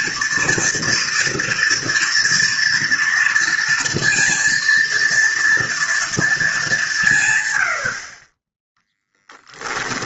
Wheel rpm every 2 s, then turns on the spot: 230, 230, 230, 190, 10.
none